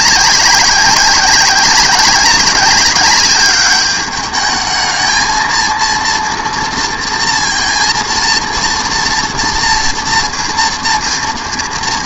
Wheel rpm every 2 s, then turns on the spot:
190, 200, 210, 230, 230, 230.
none